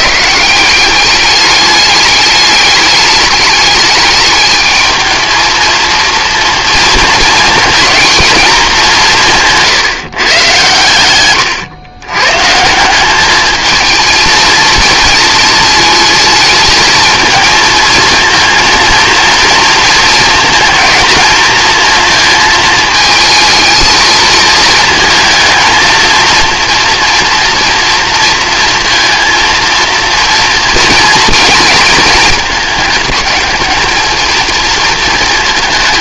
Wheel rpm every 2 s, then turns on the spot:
190, 210, 220, 230, 200, 110, 170, 230, 220, 230, 220, 220, 230, 240, 230, 230, 210, 220.
none